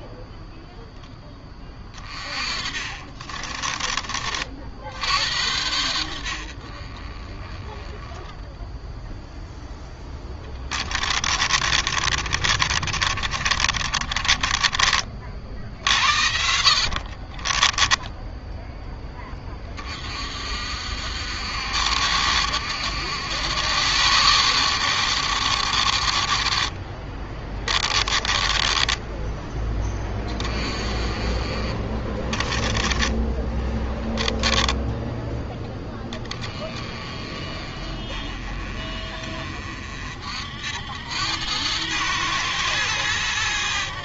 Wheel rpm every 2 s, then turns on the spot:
0, 30, 60, 60, 0, 20, 40, 30, 60, 10, 50, 70, 80, 30, 20, 20, 20, 10, 20, 30, 70, 110.
2-4 10-18 28-30 32-36